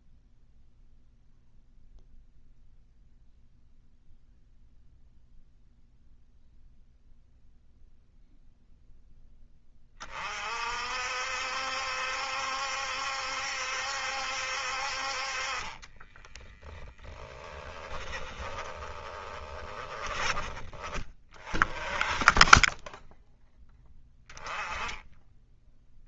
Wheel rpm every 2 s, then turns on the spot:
0, 0, 0, 0, 10, 60, 70, 50, 30, 20, 20, 10, 10.
16-20